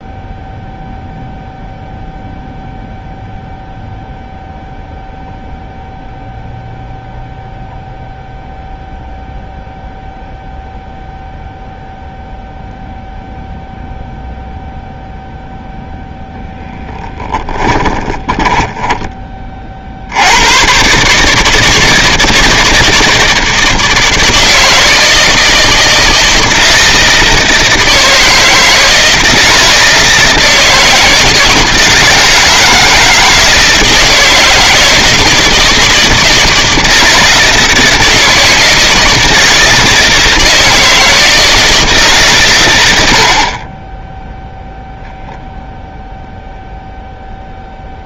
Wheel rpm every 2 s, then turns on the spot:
0, 0, 0, 0, 0, 0, 0, 0, 10, 10, 120, 160, 160, 160, 160, 160, 160, 160, 160, 160, 160, 100, 0, 0.
16-20